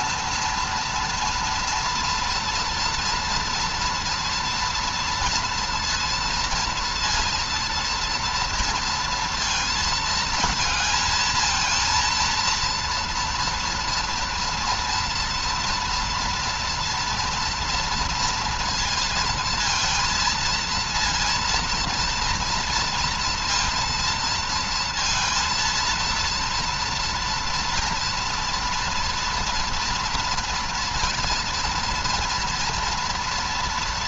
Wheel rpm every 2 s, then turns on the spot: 230, 230, 230, 230, 230, 220, 230, 230, 230, 230, 230, 230, 230, 230, 230, 240, 230.
none